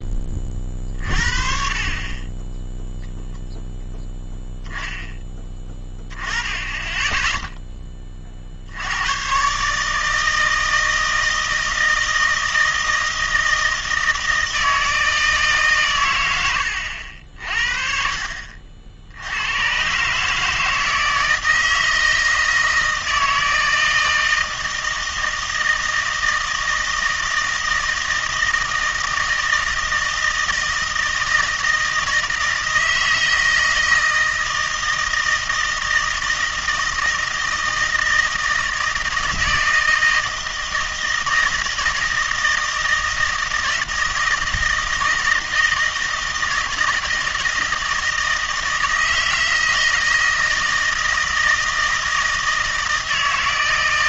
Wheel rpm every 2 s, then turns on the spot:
30, 10, 0, 10, 50, 160, 160, 160, 90, 60, 150, 160, 160, 160, 160, 160, 160, 160, 160, 160, 160, 160, 160, 160, 160, 160, 160.
none